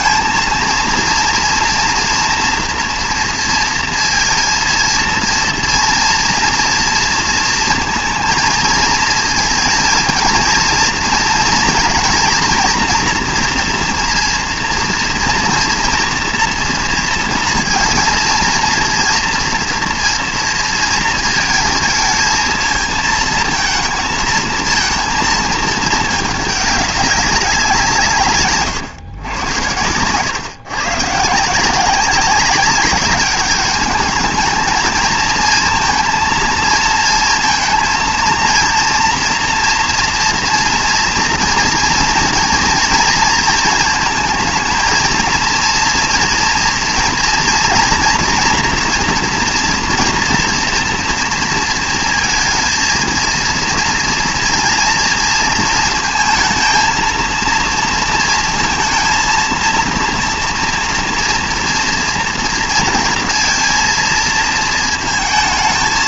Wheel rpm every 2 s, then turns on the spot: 230, 230, 230, 230, 220, 230, 230, 230, 230, 230, 230, 220, 230, 200, 120, 130, 200, 220, 230, 230, 230, 230, 220, 230, 230, 240, 230, 230, 230, 230, 230, 230, 230.
none